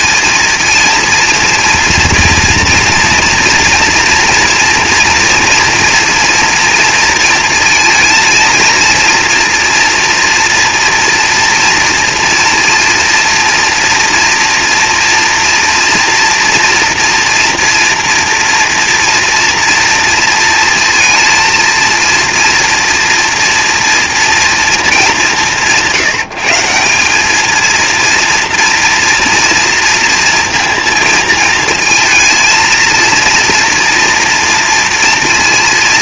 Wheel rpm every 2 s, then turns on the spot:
230, 230, 230, 230, 230, 230, 230, 230, 240, 240, 230, 230, 230, 170, 230, 230, 220, 230.
none